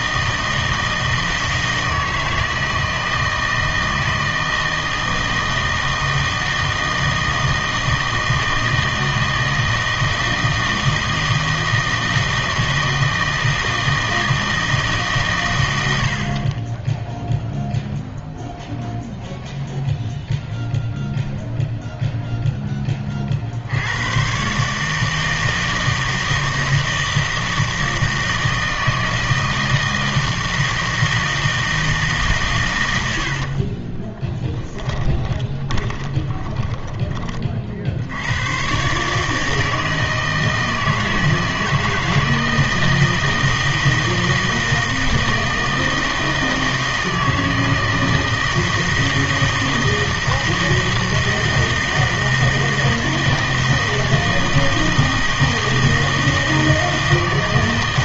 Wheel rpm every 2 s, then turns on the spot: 160, 160, 160, 160, 160, 160, 160, 160, 10, 0, 0, 10, 140, 160, 160, 160, 100, 20, 20, 120, 160, 160, 160, 160, 160, 160, 160, 160, 160.
34-38